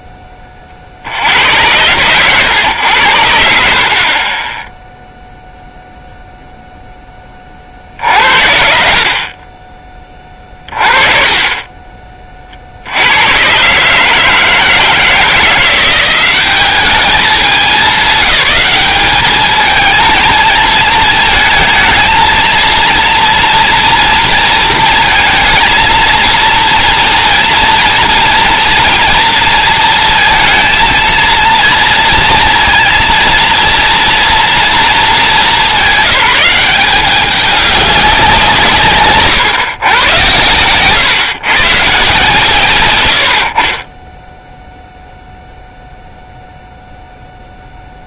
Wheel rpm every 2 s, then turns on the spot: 100, 0, 0, 60, 30, 40, 160, 190, 200, 220, 230, 230, 230, 230, 220, 230, 230, 200, 160, 110, 130, 0, 0, 0.
none